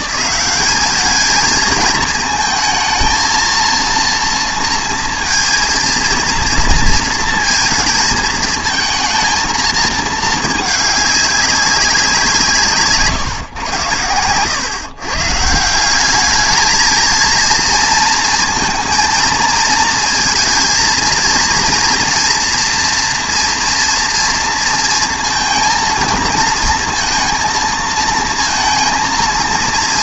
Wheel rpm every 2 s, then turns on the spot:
180, 220, 230, 230, 220, 210, 160, 120, 220, 230, 230, 230, 230, 230, 230.
none